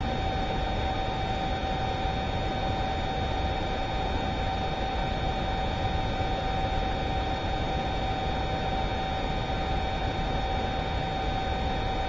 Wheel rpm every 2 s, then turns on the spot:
0, 0, 0, 0, 0, 0.
none